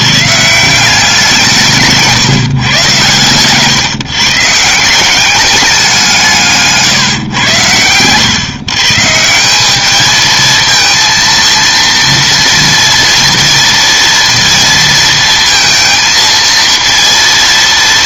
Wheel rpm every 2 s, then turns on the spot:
160, 140, 150, 150, 130, 220, 230, 230, 230.
none